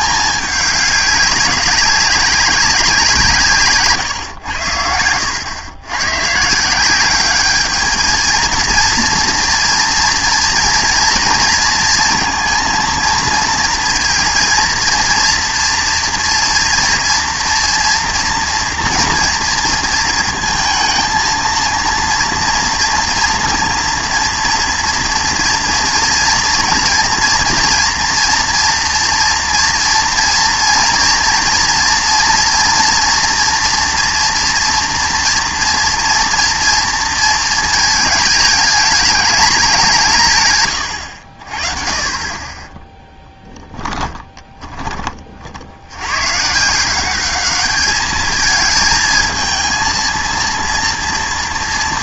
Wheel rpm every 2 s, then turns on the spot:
210, 190, 90, 140, 220, 230, 230, 230, 230, 230, 230, 230, 230, 230, 230, 230, 230, 230, 230, 210, 140, 20, 20, 150, 220, 230.
none